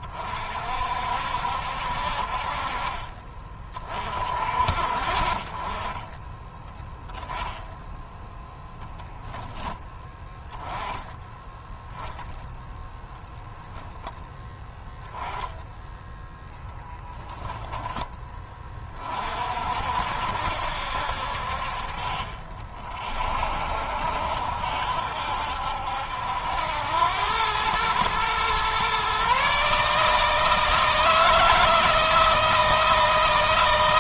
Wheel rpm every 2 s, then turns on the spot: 50, 40, 50, 10, 0, 10, 10, 10, 0, 30, 60, 40, 70, 90, 130, 160, 160.
none